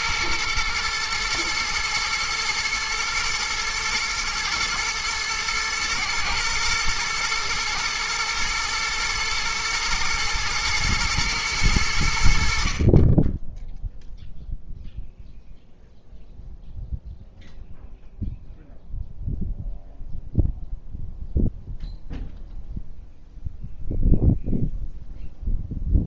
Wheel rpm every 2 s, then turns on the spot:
110, 110, 120, 120, 120, 110, 50, 0, 0, 0, 0, 0, 0.
none